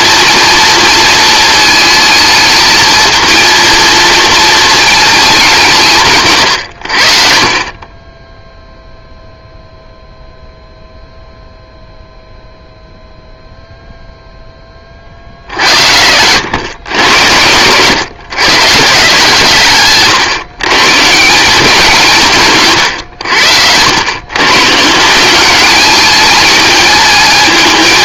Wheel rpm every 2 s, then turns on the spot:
230, 220, 220, 100, 0, 0, 0, 20, 110, 140, 140, 130, 150, 220.
none